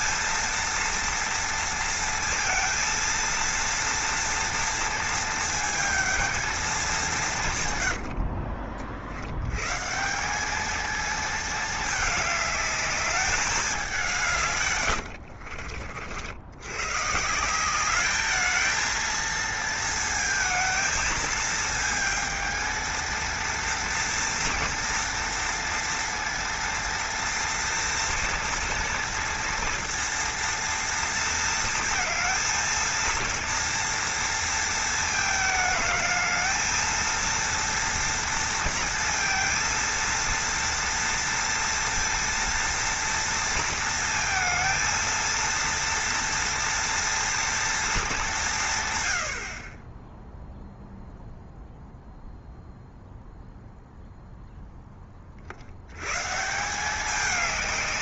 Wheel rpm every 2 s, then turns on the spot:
230, 230, 230, 200, 50, 210, 210, 130, 120, 220, 220, 220, 240, 240, 230, 230, 230, 230, 220, 230, 230, 230, 230, 230, 140, 0, 0, 10, 180.
14-16